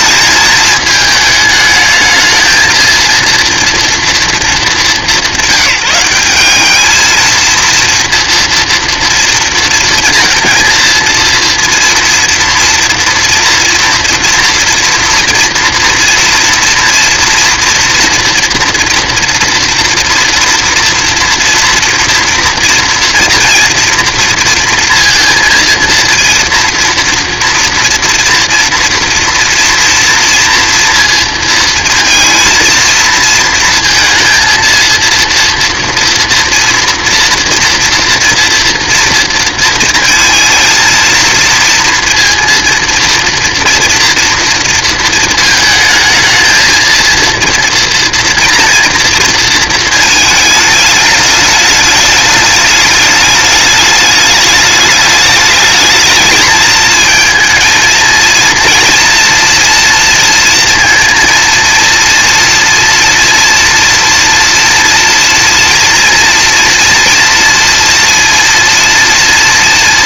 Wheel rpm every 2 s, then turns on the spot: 220, 220, 200, 210, 240, 230, 230, 230, 240, 230, 230, 230, 230, 230, 230, 230, 230, 230, 230, 230, 230, 230, 230, 230, 230, 210, 210, 210, 220, 230, 230, 230, 240, 230, 230.
none